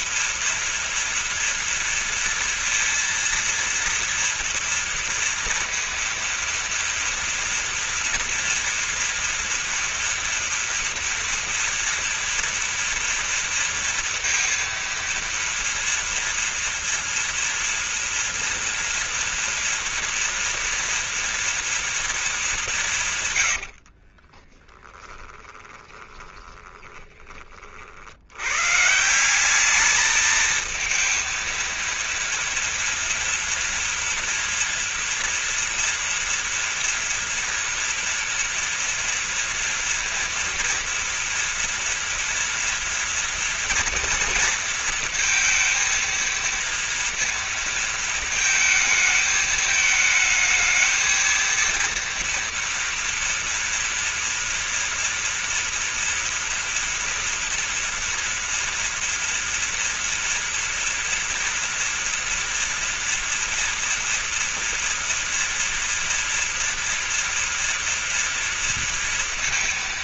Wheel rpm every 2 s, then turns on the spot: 240, 230, 230, 230, 240, 230, 240, 230, 230, 230, 230, 200, 30, 20, 130, 230, 230, 230, 230, 230, 240, 230, 230, 230, 220, 220, 230, 230, 230, 230, 230, 230, 230, 230, 230.
24-28